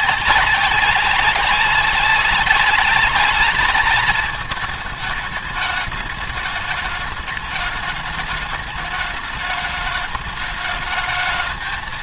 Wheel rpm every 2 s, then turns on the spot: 200, 200, 210, 210, 210, 210.
none